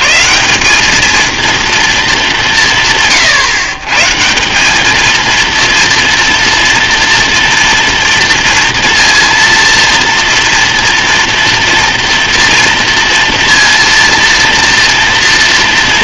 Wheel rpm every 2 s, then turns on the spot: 100, 210, 160, 230, 230, 230, 230, 240.
none